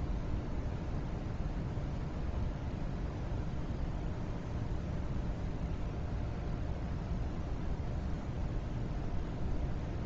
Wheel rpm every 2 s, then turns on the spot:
0, 0, 0, 0, 0.
none